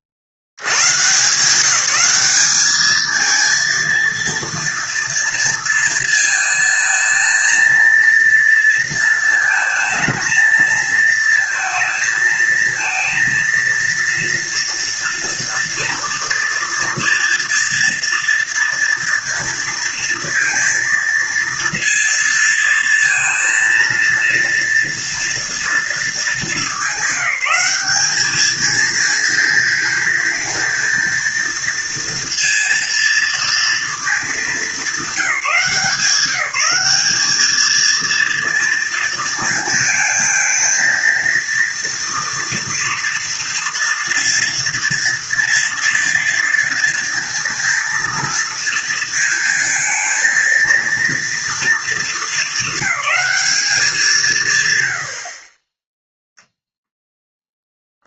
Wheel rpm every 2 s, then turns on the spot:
70, 220, 230, 220, 230, 230, 230, 230, 230, 230, 230, 230, 230, 210, 220, 230, 230, 210, 190, 230, 230, 230, 240, 230, 230, 230, 200, 110, 0.
none